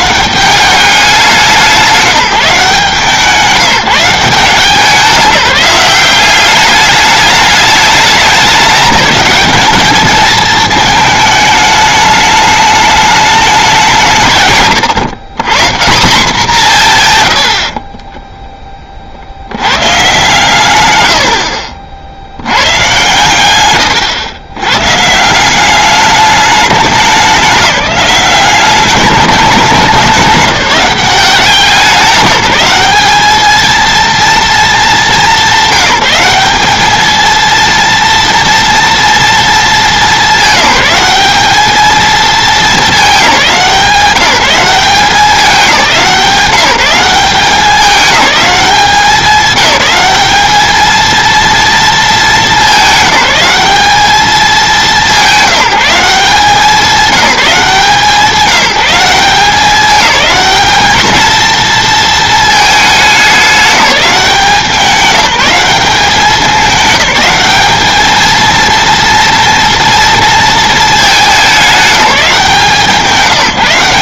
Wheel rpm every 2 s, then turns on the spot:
200, 150, 170, 200, 190, 220, 210, 140, 170, 10, 120, 100, 90, 200, 200, 190, 190, 220, 200, 230, 200, 210, 190, 180, 200, 220, 200, 200, 190, 190, 220, 220, 190, 210, 230, 230, 180.
none